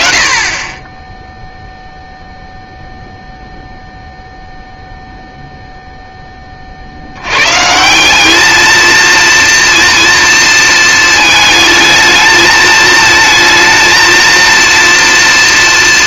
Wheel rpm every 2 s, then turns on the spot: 20, 0, 0, 50, 220, 230, 220, 230.
none